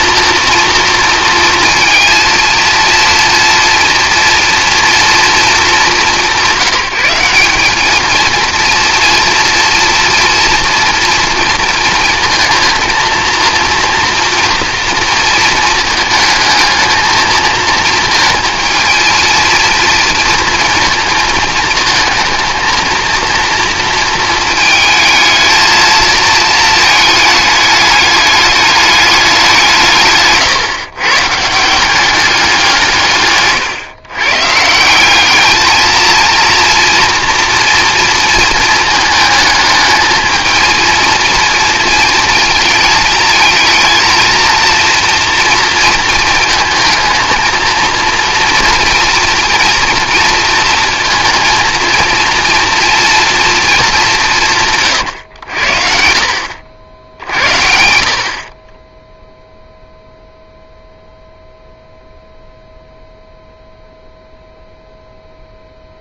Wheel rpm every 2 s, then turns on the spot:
240, 230, 230, 200, 230, 230, 230, 230, 220, 230, 230, 230, 220, 220, 210, 130, 170, 170, 230, 220, 230, 220, 230, 220, 230, 230, 240, 140, 70, 20, 0, 0, 0.
none